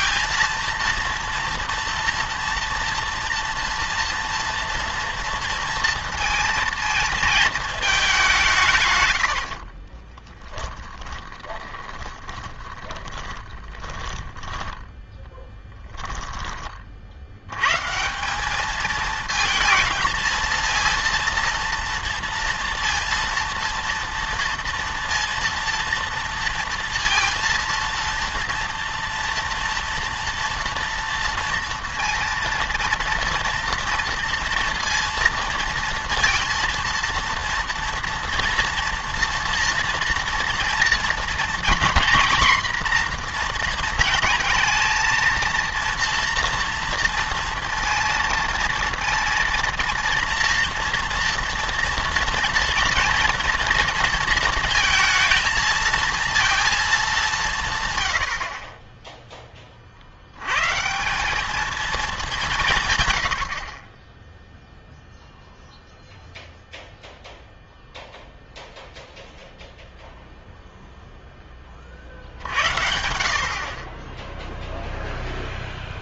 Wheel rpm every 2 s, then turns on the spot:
230, 240, 240, 230, 160, 10, 20, 10, 30, 200, 230, 230, 230, 230, 230, 230, 230, 230, 230, 230, 230, 250, 230, 240, 230, 230, 230, 230, 230, 50, 110, 170, 0, 0, 0, 0, 60, 0.
10-16